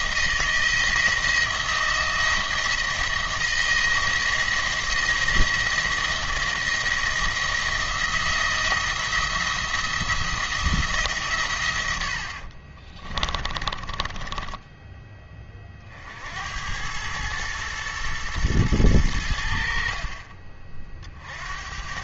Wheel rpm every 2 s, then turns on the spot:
170, 170, 170, 170, 160, 170, 40, 10, 90, 110, 40.
12-16